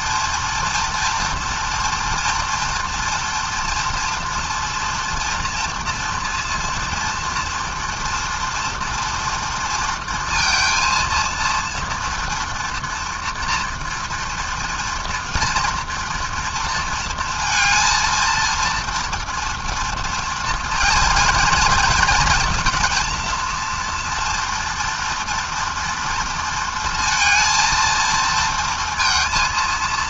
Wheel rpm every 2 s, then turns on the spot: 230, 230, 230, 230, 230, 230, 230, 230, 230, 230, 230, 230, 240, 230, 230.
none